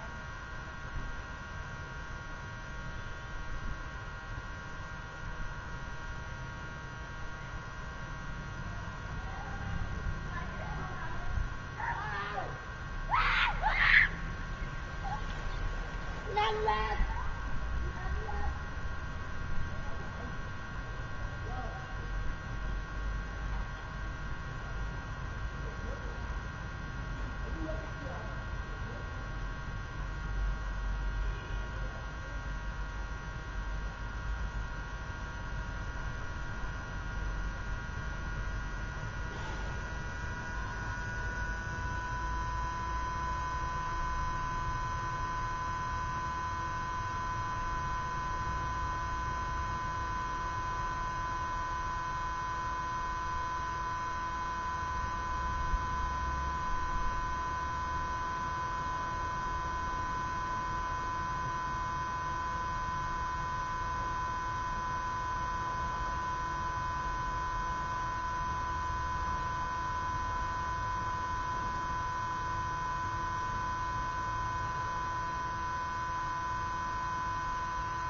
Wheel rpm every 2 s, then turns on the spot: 0, 0, 0, 0, 0, 0, 0, 0, 0, 0, 0, 0, 0, 0, 0, 0, 0, 0, 0, 0, 0, 0, 0, 0, 0, 0, 0, 0, 0, 0, 0, 0, 0, 0, 0, 0, 0, 0, 0.
none